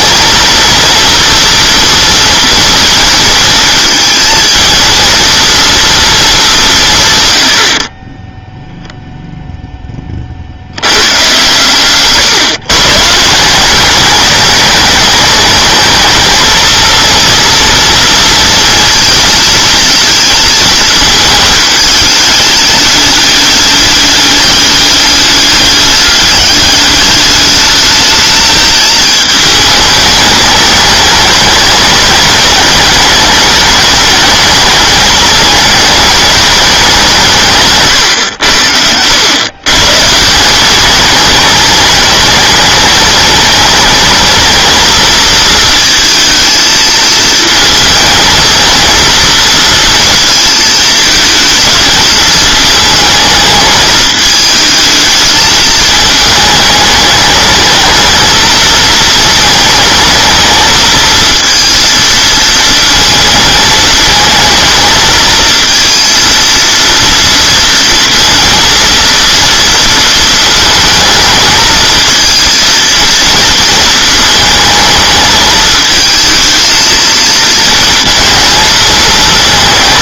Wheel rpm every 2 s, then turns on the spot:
230, 230, 220, 180, 0, 100, 140, 210, 230, 230, 220, 210, 200, 210, 220, 210, 210, 210, 200, 90, 190, 210, 230, 220, 220, 220, 220, 220, 210, 230, 220, 220, 220, 230, 230, 230, 230, 220, 220, 220.
none